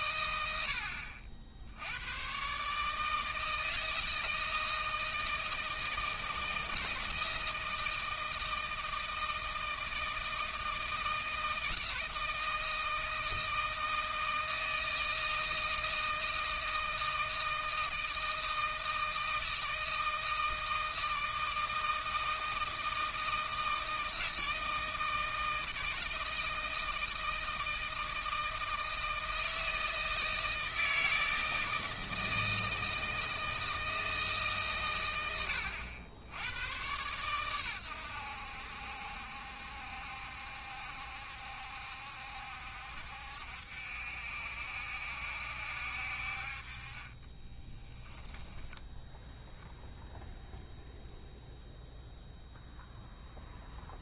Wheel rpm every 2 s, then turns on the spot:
80, 140, 160, 160, 160, 160, 160, 160, 160, 160, 160, 160, 160, 160, 160, 160, 160, 140, 110, 70, 70, 70, 70, 40, 10, 0, 0.
none